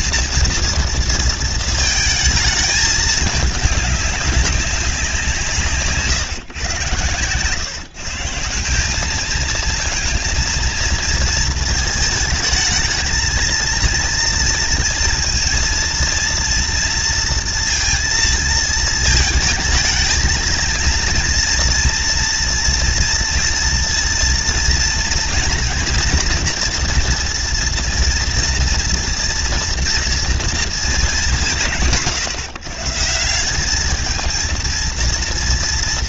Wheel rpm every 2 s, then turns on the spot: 230, 220, 200, 150, 160, 230, 220, 230, 230, 230, 220, 230, 230, 240, 230, 230, 140, 220.
none